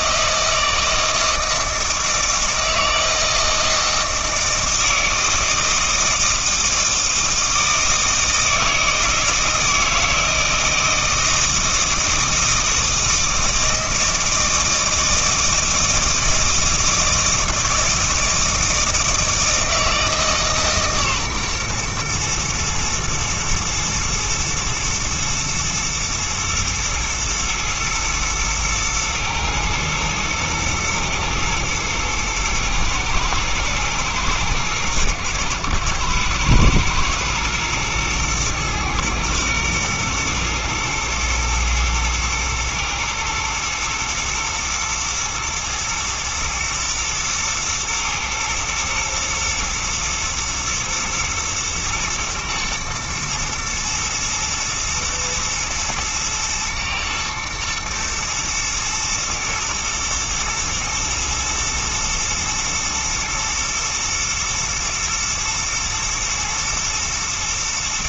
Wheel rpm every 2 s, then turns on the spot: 160, 160, 160, 160, 160, 160, 160, 160, 160, 160, 150, 120, 120, 120, 110, 110, 110, 110, 110, 120, 120, 110, 120, 120, 110, 120, 120, 110, 110, 110, 110, 120, 110, 110.
none